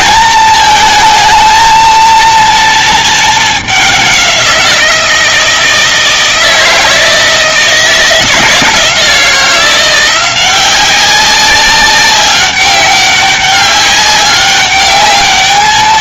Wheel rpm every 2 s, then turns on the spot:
220, 230, 180, 160, 170, 180, 200, 200.
none